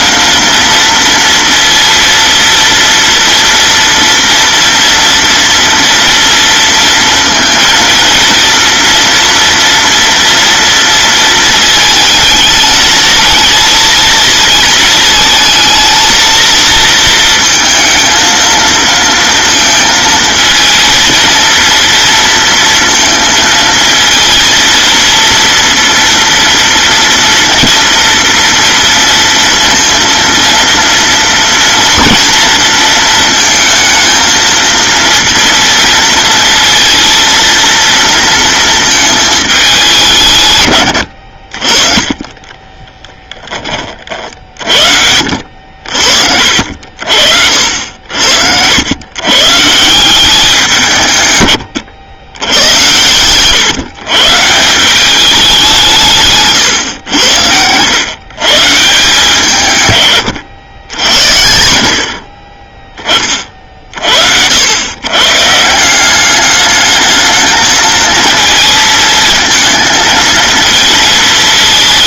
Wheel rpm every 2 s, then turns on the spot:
230, 230, 230, 230, 230, 230, 220, 220, 230, 230, 220, 230, 230, 230, 230, 230, 230, 230, 230, 220, 120, 20, 50, 60, 90, 170, 100, 160, 130, 140, 100, 30, 90, 210, 230, 230.
42-44